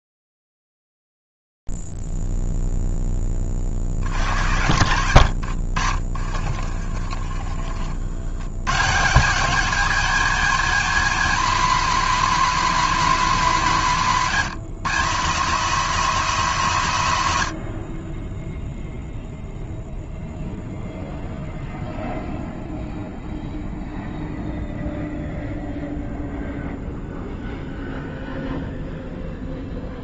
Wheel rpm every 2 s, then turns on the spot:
0, 0, 50, 50, 50, 210, 220, 190, 210, 50, 0, 0, 0, 0, 0.
6-8